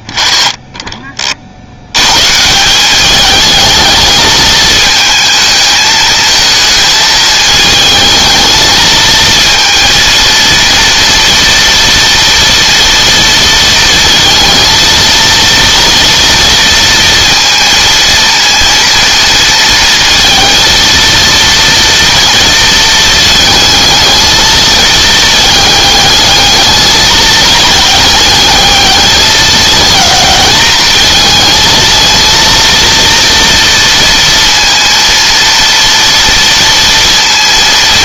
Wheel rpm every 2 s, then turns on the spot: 30, 190, 220, 220, 220, 230, 230, 230, 230, 230, 230, 220, 220, 220, 210, 220, 230, 230, 230.
none